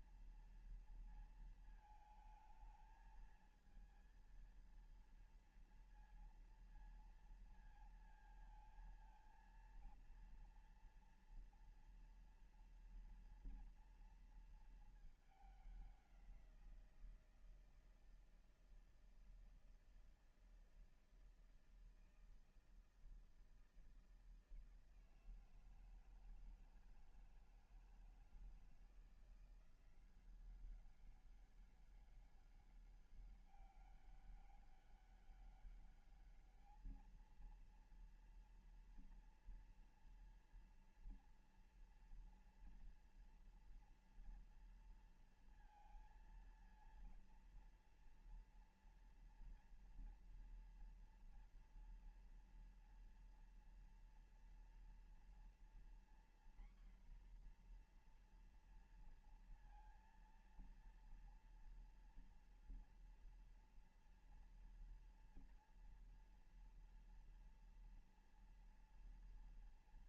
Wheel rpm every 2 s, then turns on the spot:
230, 220, 230, 230, 220, 230, 230, 230, 180, 160, 160, 160, 160, 160, 160, 190, 200, 200, 210, 230, 230, 230, 230, 230, 230, 230, 230, 230, 240, 240, 230, 230, 230, 230, 230.
none